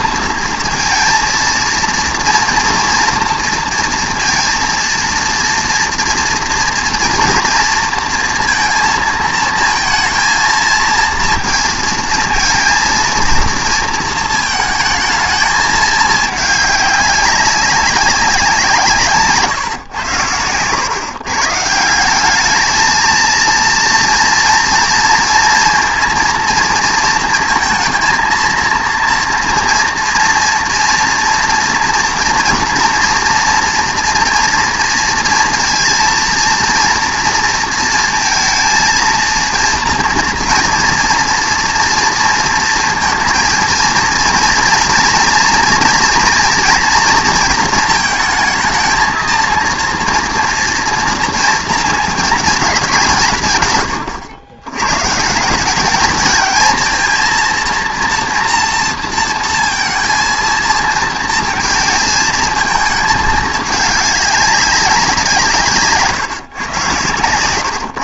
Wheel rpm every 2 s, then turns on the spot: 230, 230, 230, 230, 230, 220, 230, 220, 200, 180, 110, 210, 230, 230, 230, 230, 240, 230, 230, 230, 230, 230, 230, 230, 220, 230, 200, 110, 220, 230, 230, 220, 200, 130.
none